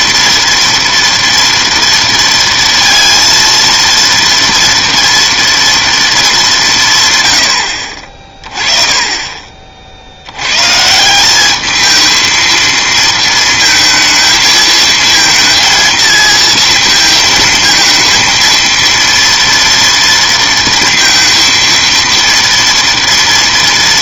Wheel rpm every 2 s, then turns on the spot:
230, 230, 230, 180, 20, 140, 220, 220, 230, 230, 230, 230.
none